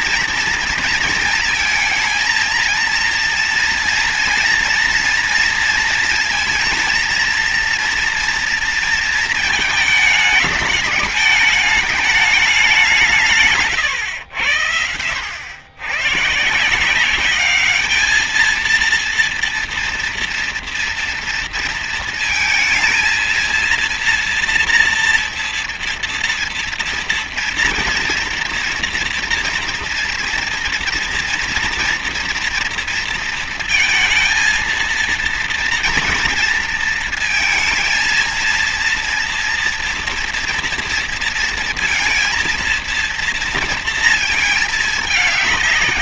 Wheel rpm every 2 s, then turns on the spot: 230, 230, 230, 230, 230, 210, 200, 90, 140, 220, 230, 230, 240, 240, 240, 240, 230, 230, 230, 230, 230, 230, 220.
none